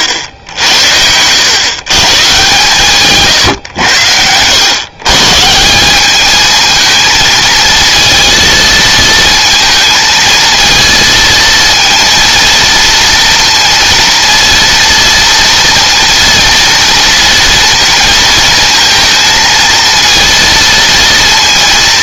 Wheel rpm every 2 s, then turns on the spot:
80, 140, 140, 220, 230, 230, 230, 230, 230, 230, 230.
none